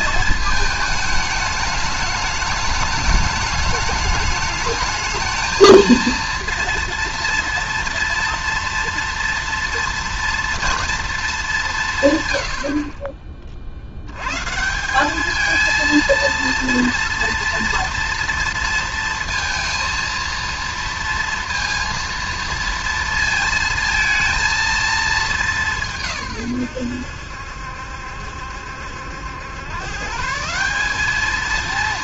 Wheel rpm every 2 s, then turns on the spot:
220, 210, 210, 230, 240, 230, 100, 150, 230, 230, 230, 230, 230, 120, 70, 170.
none